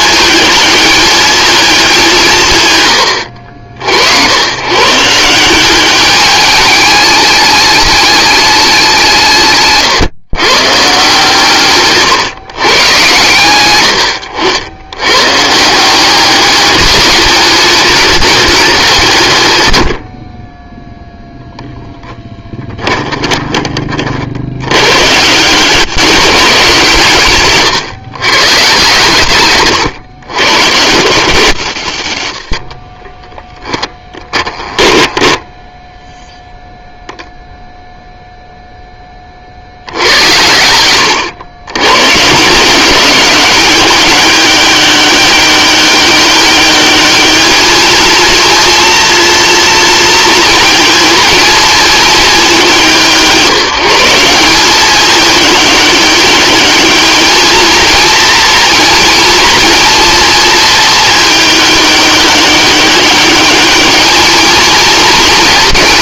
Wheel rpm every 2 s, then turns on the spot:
210, 90, 140, 210, 190, 150, 130, 80, 200, 170, 0, 20, 110, 160, 140, 140, 40, 20, 0, 10, 90, 180, 200, 200, 230, 220, 150, 200, 210, 230, 220, 200, 230.
22-24 32-36